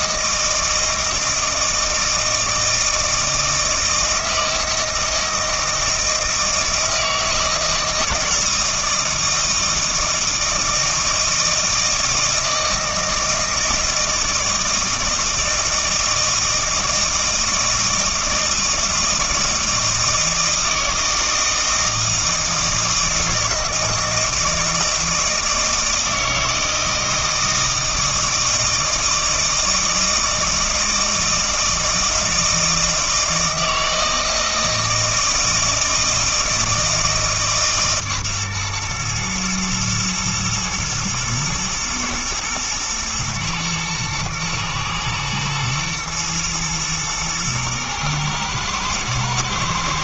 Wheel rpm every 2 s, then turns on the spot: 160, 160, 160, 160, 160, 160, 160, 160, 160, 160, 160, 160, 160, 160, 160, 160, 160, 160, 160, 120, 110, 110, 110, 120, 110.
none